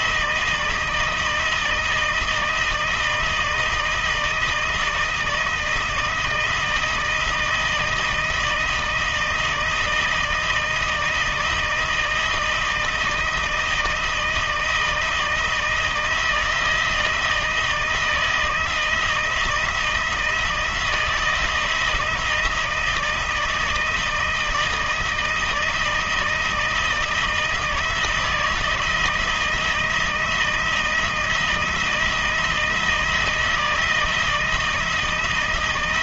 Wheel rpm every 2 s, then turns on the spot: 160, 160, 160, 160, 160, 160, 160, 160, 160, 170, 160, 160, 160, 160, 160, 170, 160, 160.
none